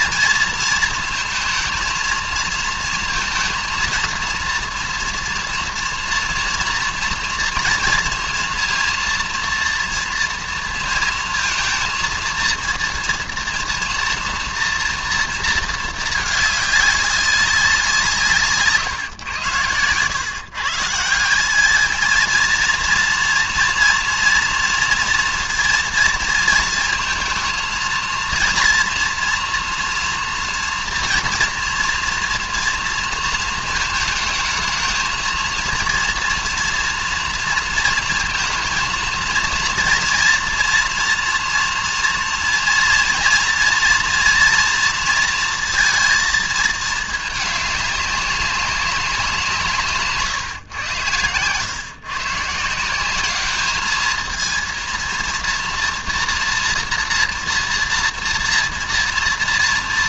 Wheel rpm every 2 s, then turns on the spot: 230, 220, 230, 230, 230, 230, 230, 230, 210, 140, 150, 230, 230, 230, 230, 230, 230, 220, 240, 230, 230, 230, 230, 220, 200, 120, 160, 230, 230, 230.
none